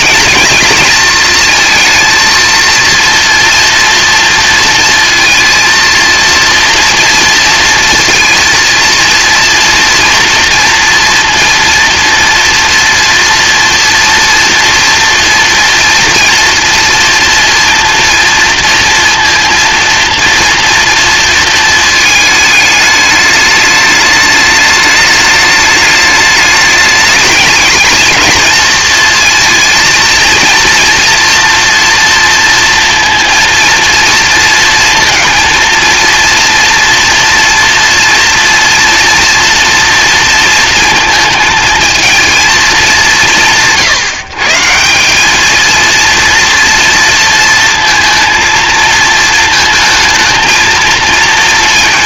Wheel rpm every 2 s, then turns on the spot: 220, 230, 230, 230, 230, 230, 230, 240, 230, 230, 230, 210, 210, 210, 220, 230, 230, 230, 230, 230, 230, 200, 160, 230, 230, 220.
none